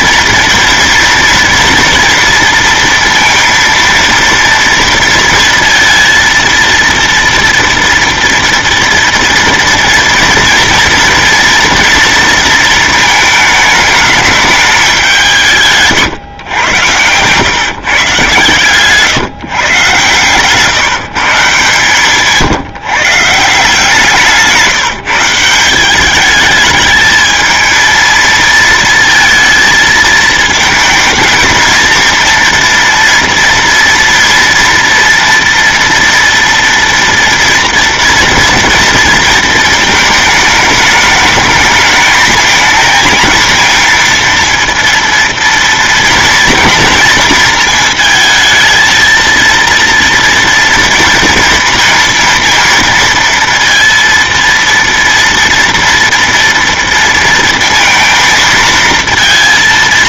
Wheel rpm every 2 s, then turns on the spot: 230, 230, 230, 230, 240, 230, 230, 210, 110, 130, 140, 150, 170, 210, 230, 220, 230, 230, 230, 230, 210, 220, 230, 230, 220, 230, 230, 230, 230, 230.
16-18